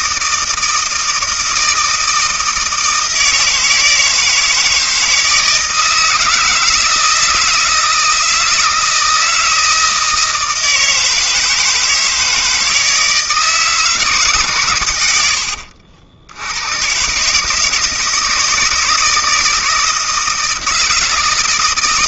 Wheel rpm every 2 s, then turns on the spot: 160, 160, 160, 160, 160, 160, 160, 130, 100, 150, 160.
none